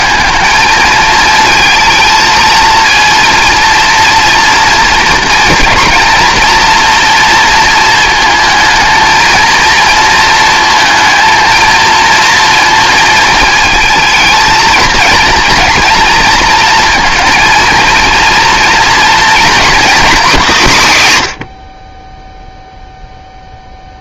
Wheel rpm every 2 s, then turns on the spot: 220, 230, 240, 230, 220, 230, 230, 220, 230, 230, 170, 0.
none